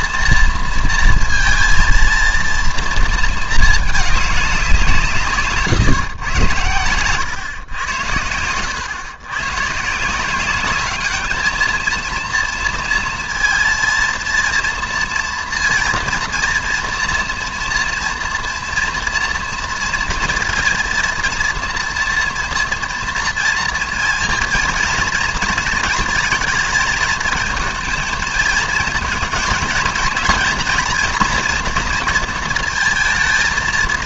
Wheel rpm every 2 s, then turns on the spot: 230, 230, 180, 100, 100, 200, 230, 230, 230, 230, 230, 230, 230, 220, 220, 240, 220.
none